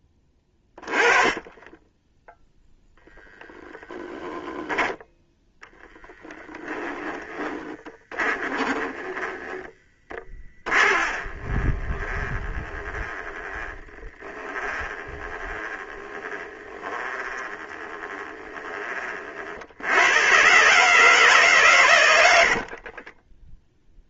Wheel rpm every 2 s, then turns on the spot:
20, 0, 10, 10, 10, 30, 20, 20, 20, 30, 140, 40.
0-2 6-18 22-24